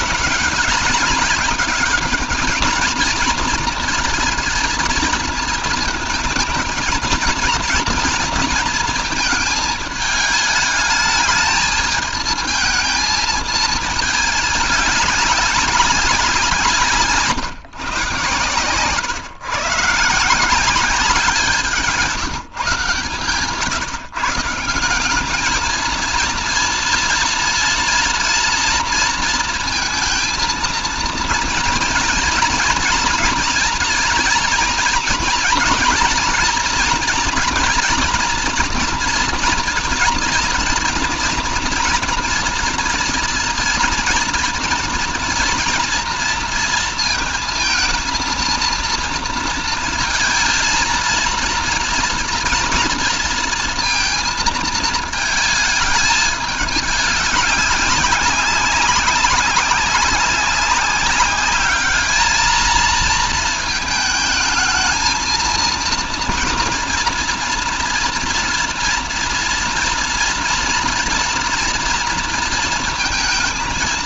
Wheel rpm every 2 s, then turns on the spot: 200, 220, 230, 220, 230, 210, 220, 200, 170, 130, 180, 150, 180, 230, 230, 230, 230, 230, 230, 240, 230, 230, 230, 230, 230, 230, 230, 220, 210, 200, 190, 220, 220, 230, 230, 230, 230.
16-18